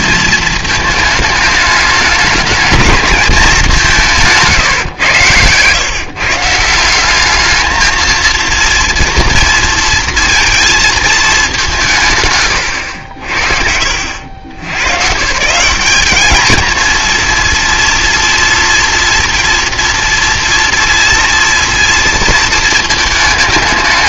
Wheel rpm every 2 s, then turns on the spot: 220, 210, 140, 160, 230, 230, 100, 90, 220, 230, 230, 220.
4-6